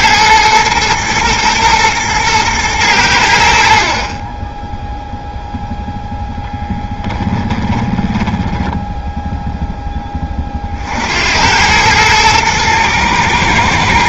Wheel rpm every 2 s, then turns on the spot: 110, 110, 10, 0, 10, 50, 110.
8-10